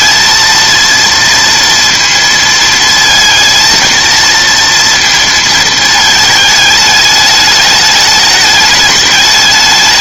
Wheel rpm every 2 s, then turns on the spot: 230, 230, 230, 210, 210.
none